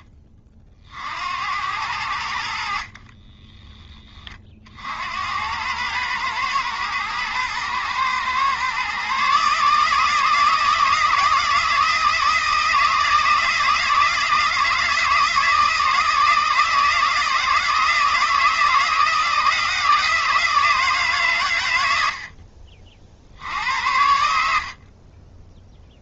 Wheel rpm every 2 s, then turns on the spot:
50, 50, 60, 110, 130, 160, 160, 160, 160, 160, 150, 50, 50.
none